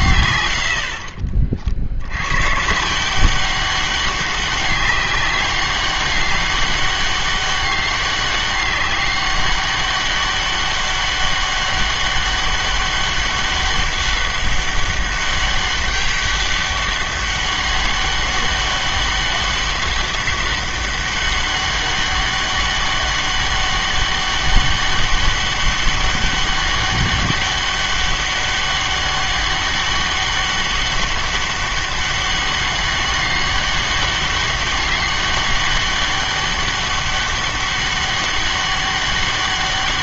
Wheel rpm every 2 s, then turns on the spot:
80, 140, 200, 200, 200, 200, 200, 200, 200, 200, 200, 200, 200, 200, 200, 200, 200, 200, 200, 200.
none